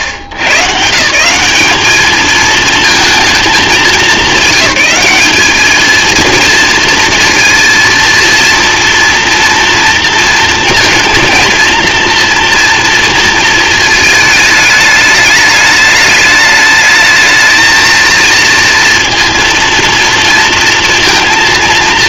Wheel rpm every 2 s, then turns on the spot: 120, 220, 190, 230, 230, 230, 230, 210, 220, 230, 230.
none